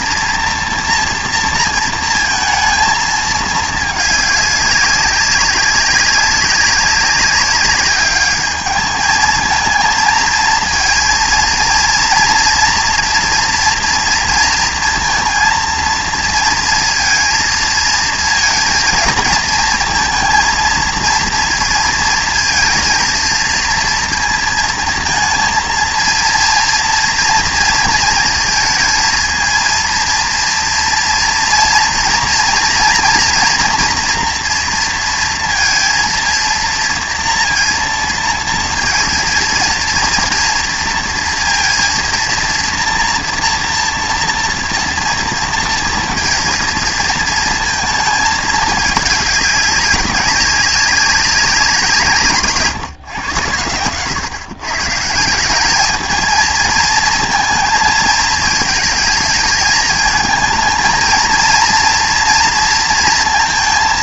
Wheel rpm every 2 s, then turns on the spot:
230, 230, 200, 190, 210, 220, 230, 230, 230, 230, 230, 230, 230, 230, 230, 230, 230, 230, 230, 230, 230, 230, 230, 230, 210, 190, 150, 140, 220, 220, 220, 230.
none